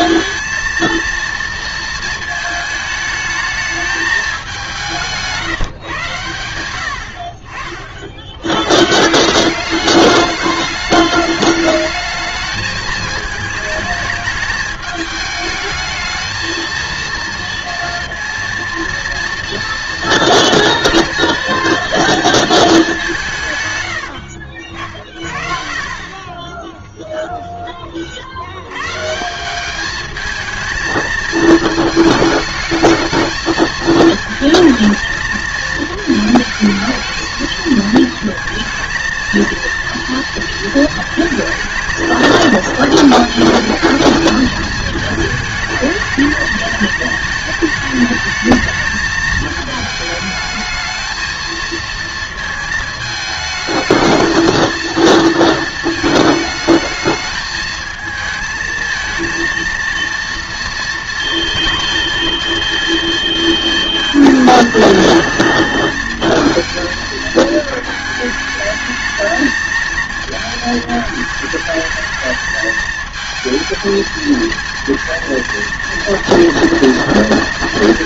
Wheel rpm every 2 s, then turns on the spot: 230, 220, 180, 70, 140, 210, 220, 210, 220, 230, 240, 220, 60, 10, 120, 220, 210, 220, 220, 220, 230, 220, 220, 220, 220, 210, 220, 220, 220, 220, 230, 230, 220, 220, 220, 220, 220, 230, 230.
none